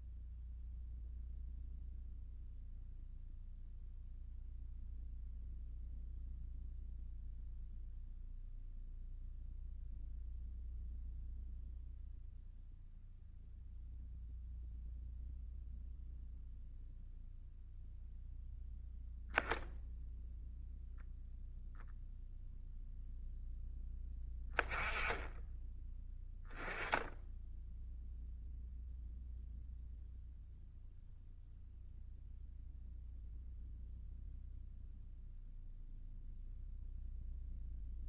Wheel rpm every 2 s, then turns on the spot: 0, 0, 0, 0, 0, 0, 0, 0, 0, 0, 0, 0, 10, 10, 0, 0, 0, 0, 0.
none